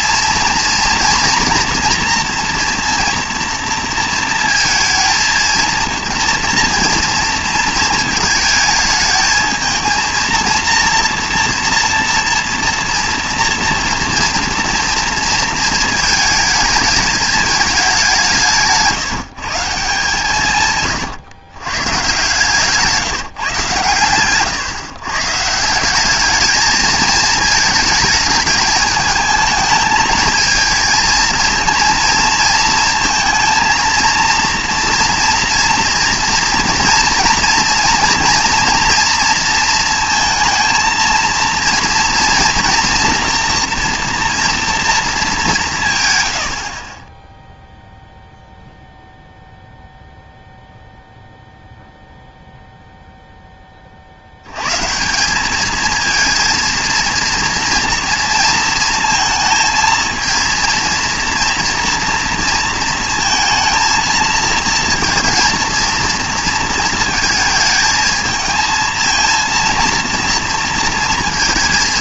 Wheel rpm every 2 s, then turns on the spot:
230, 230, 230, 230, 220, 230, 230, 230, 220, 170, 140, 140, 130, 220, 210, 220, 230, 230, 230, 230, 230, 230, 230, 50, 0, 0, 0, 110, 230, 230, 230, 230, 230, 230, 220, 230.
22-24